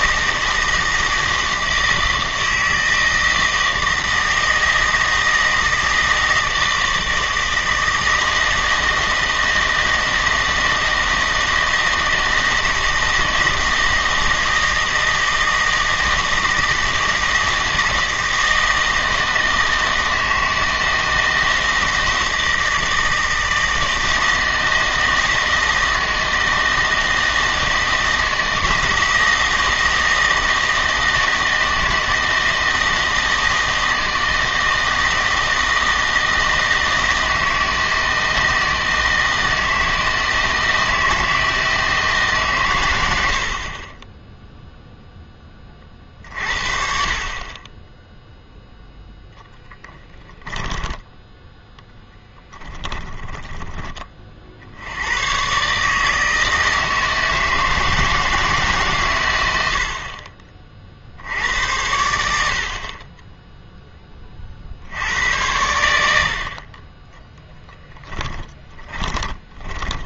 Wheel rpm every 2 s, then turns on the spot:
160, 160, 160, 160, 160, 160, 160, 160, 160, 160, 160, 160, 160, 160, 160, 160, 160, 160, 160, 160, 160, 120, 0, 50, 0, 10, 10, 70, 160, 150, 40, 70, 50, 40, 20.
50-54 68-70